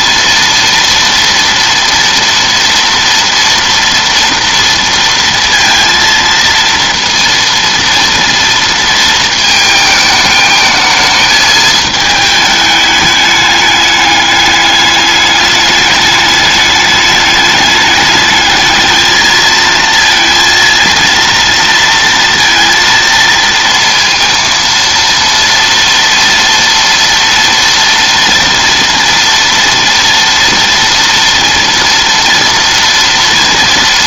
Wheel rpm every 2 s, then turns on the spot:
230, 230, 230, 230, 230, 220, 210, 210, 210, 220, 230, 230, 230, 230, 230, 230, 230.
none